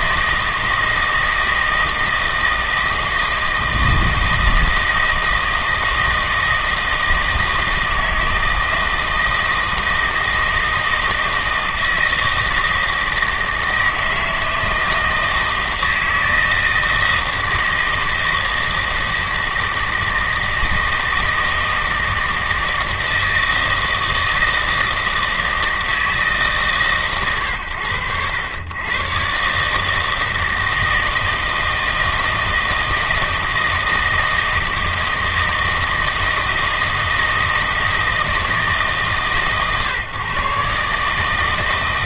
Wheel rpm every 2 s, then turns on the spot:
160, 160, 160, 160, 160, 160, 160, 160, 160, 160, 160, 160, 160, 140, 110, 160, 160, 160, 160, 150, 140.
none